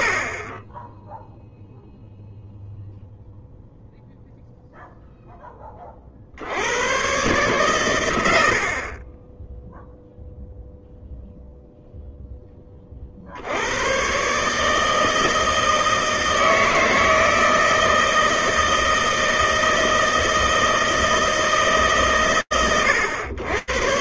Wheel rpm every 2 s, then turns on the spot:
20, 0, 20, 120, 0, 0, 120, 160, 160, 160, 140, 100.
none